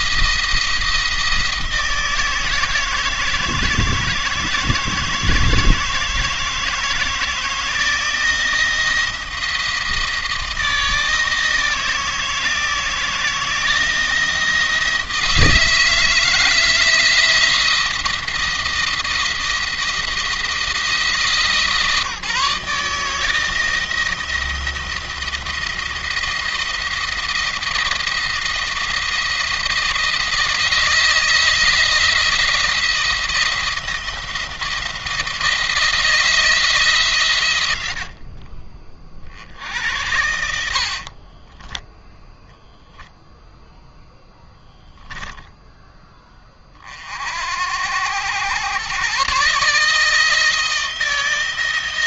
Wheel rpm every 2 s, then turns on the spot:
170, 160, 160, 160, 170, 160, 160, 170, 160, 170, 160, 160, 170, 170, 170, 160, 170, 170, 160, 50, 60, 10, 0, 30, 110, 160.
40-42